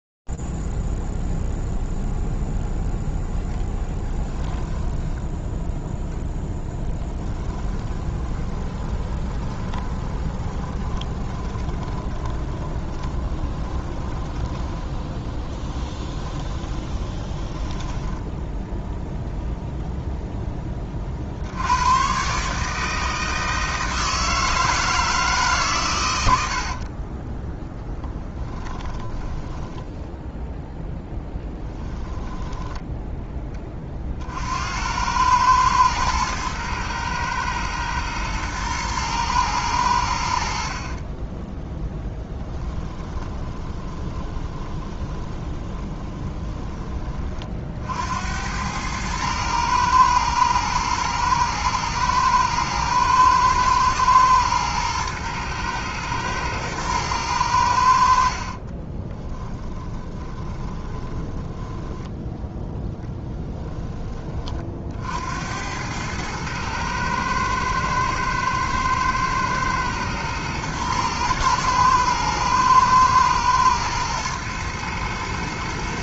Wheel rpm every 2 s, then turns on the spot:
0, 0, 10, 0, 20, 20, 20, 10, 20, 10, 10, 140, 160, 90, 10, 0, 10, 80, 110, 110, 50, 20, 20, 20, 100, 110, 110, 110, 110, 30, 20, 10, 50, 110, 110, 110, 110, 110.
4-6 8-20 28-30 42-46 58-64